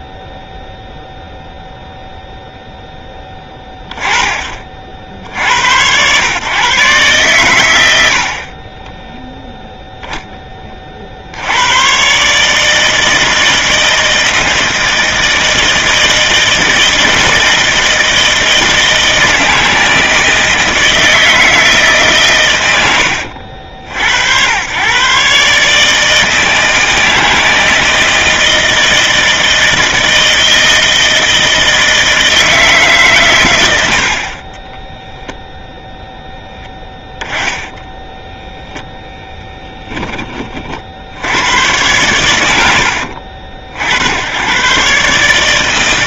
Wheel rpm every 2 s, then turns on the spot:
0, 0, 30, 110, 80, 20, 140, 160, 160, 160, 160, 120, 100, 160, 160, 160, 160, 30, 0, 10, 40, 80, 110.
34-36